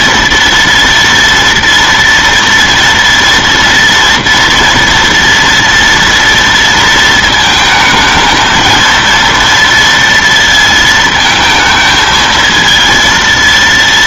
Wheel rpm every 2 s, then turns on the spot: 230, 230, 230, 230, 230, 220, 230.
none